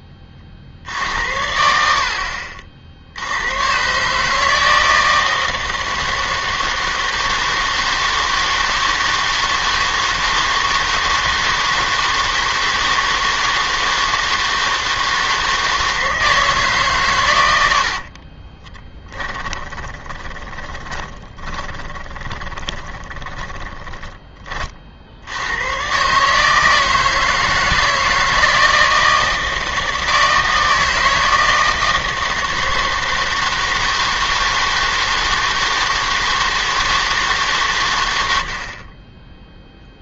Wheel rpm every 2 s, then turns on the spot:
40, 60, 160, 160, 160, 160, 160, 160, 150, 20, 20, 20, 40, 160, 160, 160, 160, 160, 160, 50.
18-24